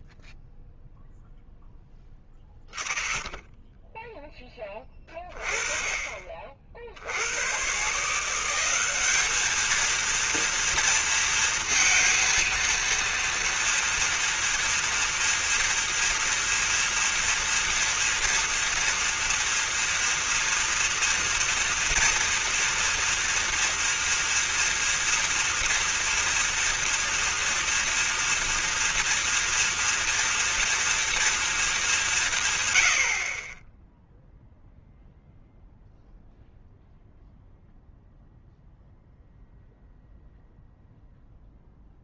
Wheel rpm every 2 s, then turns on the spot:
0, 20, 20, 30, 170, 230, 230, 230, 230, 230, 230, 230, 240, 240, 230, 230, 120, 0, 0, 0, 0.
none